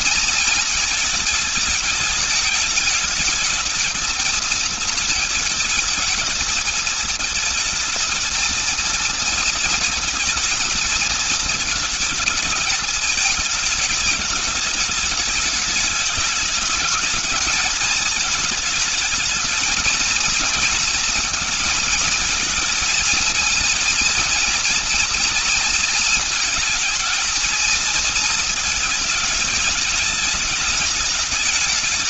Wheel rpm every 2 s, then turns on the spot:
230, 210, 220, 220, 230, 230, 220, 200, 220, 220, 230, 230, 230, 220, 220, 210.
none